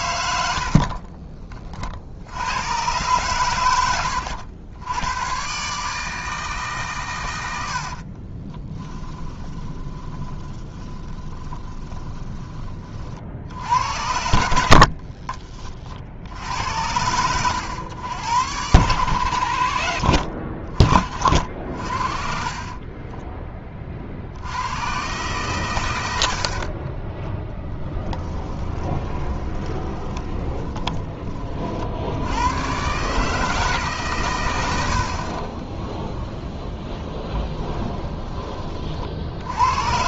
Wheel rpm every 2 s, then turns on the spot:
50, 120, 100, 130, 20, 20, 30, 60, 80, 90, 30, 30, 110, 30, 20, 10, 120, 80, 0, 40.
0-2 8-12 16-18 22-24 26-32